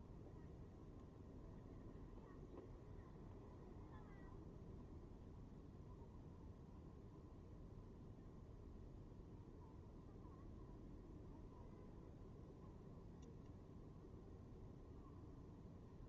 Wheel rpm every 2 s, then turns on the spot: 0, 0, 0, 0, 0, 0, 0, 0.
none